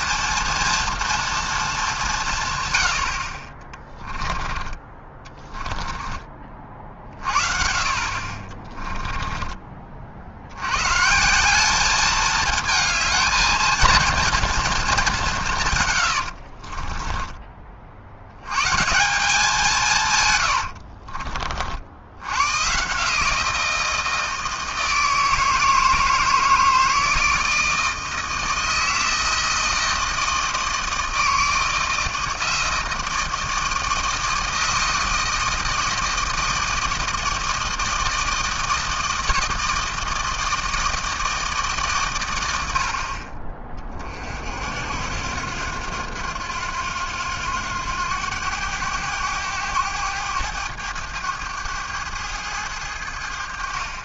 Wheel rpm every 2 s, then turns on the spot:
230, 130, 20, 30, 30, 90, 220, 230, 50, 120, 100, 110, 160, 160, 160, 160, 160, 160, 160, 160, 160, 100, 60, 90, 100, 100, 100.
8-10 16-18 20-22